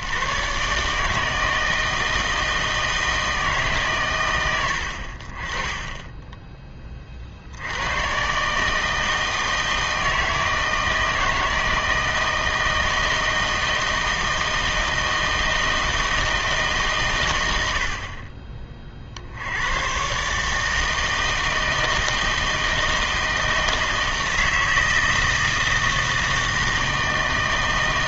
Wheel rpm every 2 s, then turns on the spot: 130, 160, 80, 20, 150, 160, 160, 160, 150, 30, 150, 160, 160, 160.
none